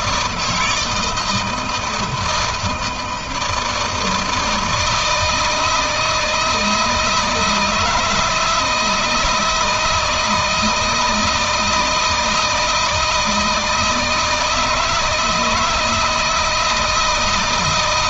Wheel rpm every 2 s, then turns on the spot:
160, 160, 160, 160, 160, 160, 160, 160, 170.
none